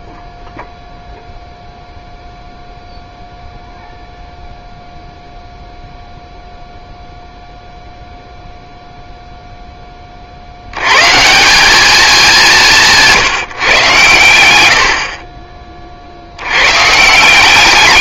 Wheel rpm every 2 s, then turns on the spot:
0, 0, 0, 0, 0, 70, 190, 100, 90.
none